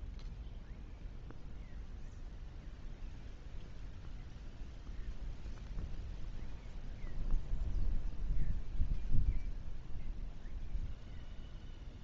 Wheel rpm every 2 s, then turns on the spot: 0, 0, 0, 0, 0, 0.
none